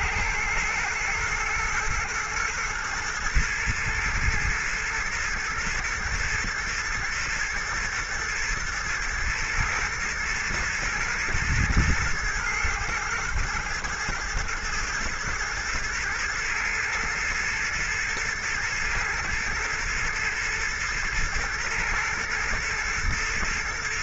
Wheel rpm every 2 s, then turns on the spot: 120, 110, 110, 120, 110, 110, 120, 120, 110, 110, 120, 120.
none